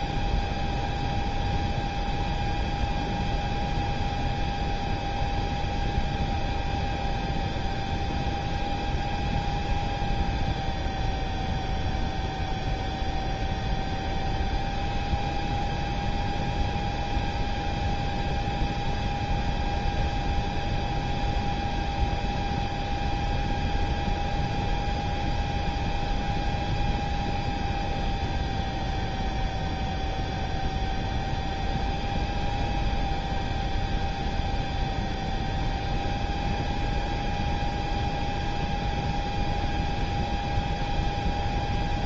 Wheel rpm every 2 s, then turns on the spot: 0, 0, 0, 0, 0, 0, 0, 0, 0, 0, 0, 0, 0, 0, 0, 0, 0, 0, 0, 0, 0.
none